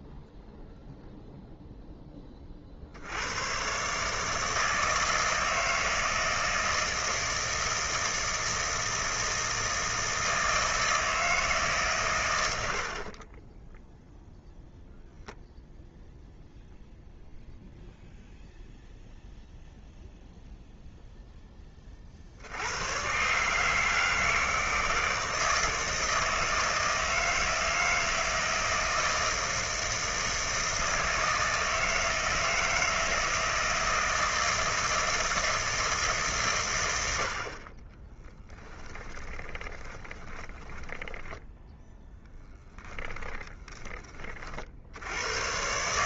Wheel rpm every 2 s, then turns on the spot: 0, 10, 150, 160, 160, 160, 110, 0, 0, 0, 0, 110, 160, 160, 160, 160, 160, 160, 110, 10, 10, 10, 70.
38-42